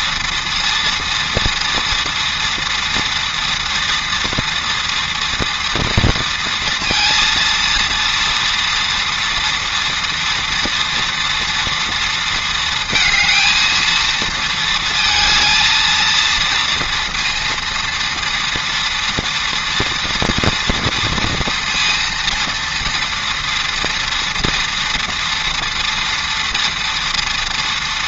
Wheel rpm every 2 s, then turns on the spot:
230, 230, 230, 230, 230, 230, 230, 230, 230, 230, 240, 230, 230, 230.
none